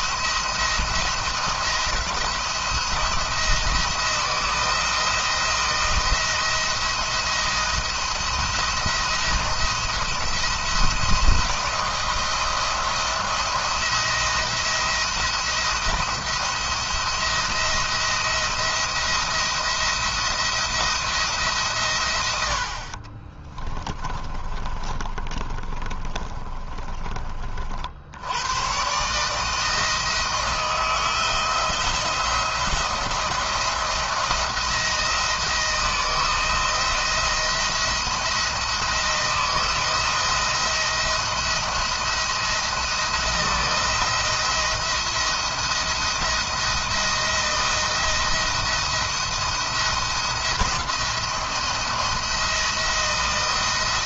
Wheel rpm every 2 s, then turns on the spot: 160, 160, 170, 170, 170, 170, 160, 170, 170, 170, 170, 50, 30, 20, 130, 160, 170, 170, 170, 170, 170, 170, 170, 170, 170, 170, 170.
22-26